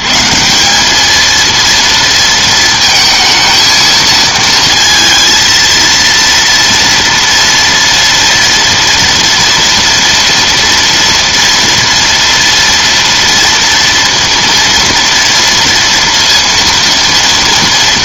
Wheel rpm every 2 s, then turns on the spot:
130, 230, 230, 230, 230, 240, 230, 230, 230.
none